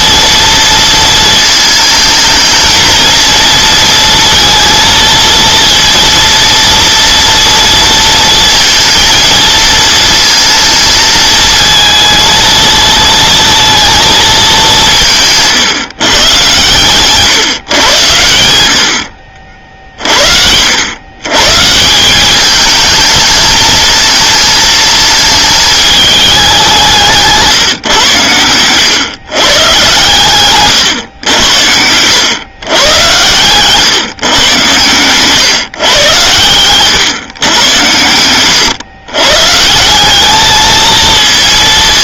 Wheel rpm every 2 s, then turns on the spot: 230, 220, 230, 230, 230, 230, 230, 200, 130, 80, 70, 210, 220, 190, 110, 130, 110, 120, 110, 110, 220.
28-30